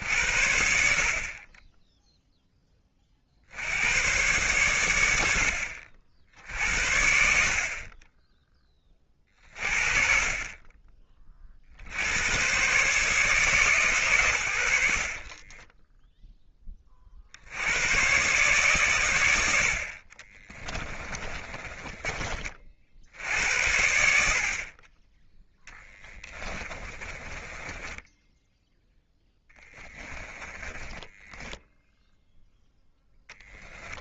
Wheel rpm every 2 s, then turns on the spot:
60, 30, 100, 70, 40, 30, 140, 40, 60, 80, 20, 80, 20, 20, 10, 20, 10.
14-16 20-22 26-28 30-32